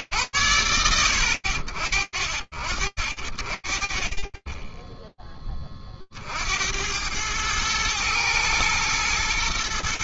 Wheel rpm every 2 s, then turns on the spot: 70, 30, 20, 110, 120.
none